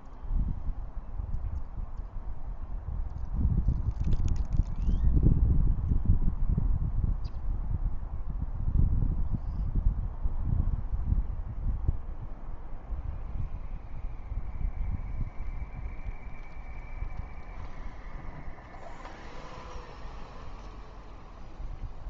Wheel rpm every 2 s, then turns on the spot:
0, 0, 0, 0, 0, 0, 0, 0, 0, 0, 0.
none